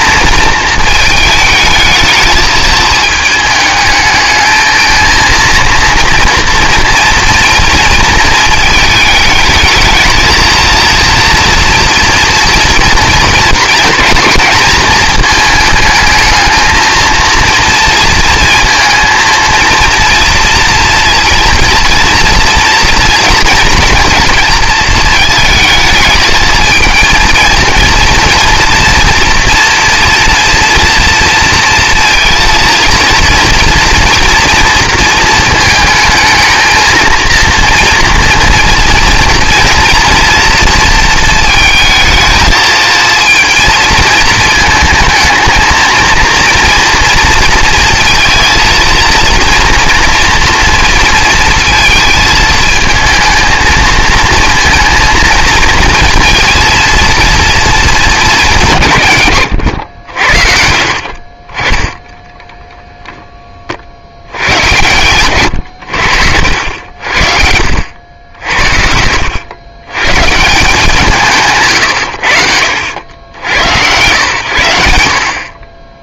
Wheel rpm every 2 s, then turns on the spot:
220, 220, 220, 230, 220, 230, 230, 220, 220, 220, 230, 230, 230, 220, 240, 230, 230, 230, 220, 240, 230, 230, 220, 230, 230, 230, 220, 230, 230, 170, 60, 10, 100, 80, 70, 170, 80, 80.
60-62 66-68